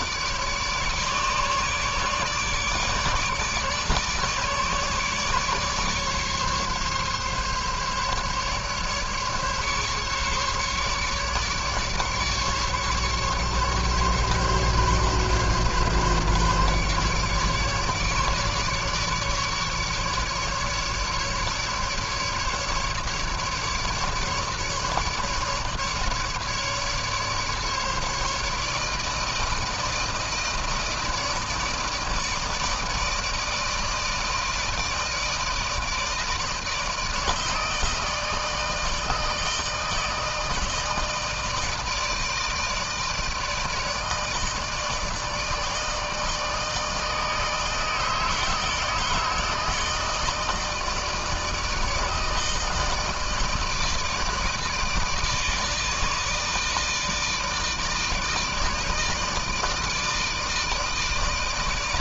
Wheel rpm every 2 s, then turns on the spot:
150, 150, 150, 140, 140, 140, 150, 140, 140, 150, 150, 150, 150, 150, 150, 160, 160, 160, 160, 160, 160, 160, 160, 160, 160, 160, 160, 160, 160, 160, 160.
none